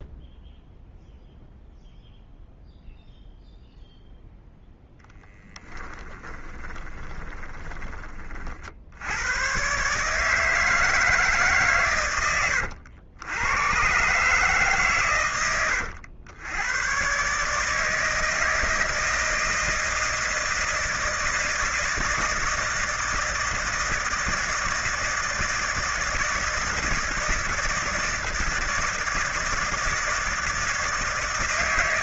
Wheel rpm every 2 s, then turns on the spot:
0, 0, 0, 20, 50, 150, 90, 140, 100, 160, 160, 160, 160, 160, 160, 160.
6-8